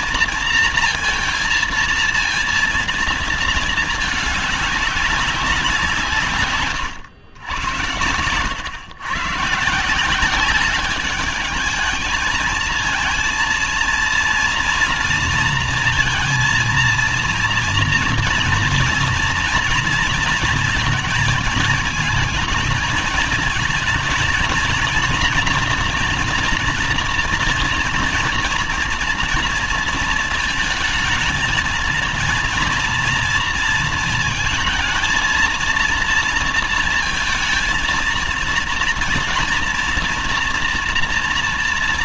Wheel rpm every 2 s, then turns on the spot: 230, 230, 200, 140, 120, 200, 230, 230, 230, 230, 230, 220, 230, 230, 230, 220, 230, 230, 230, 230, 230.
none